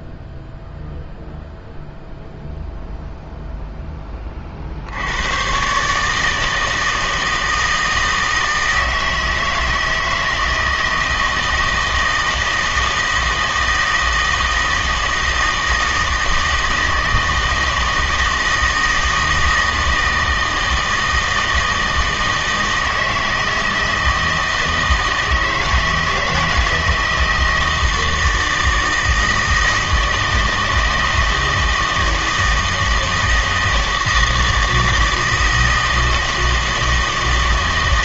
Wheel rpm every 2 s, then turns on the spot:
0, 0, 50, 160, 160, 160, 160, 160, 160, 160, 160, 160, 160, 160, 160, 160, 160, 160, 160.
none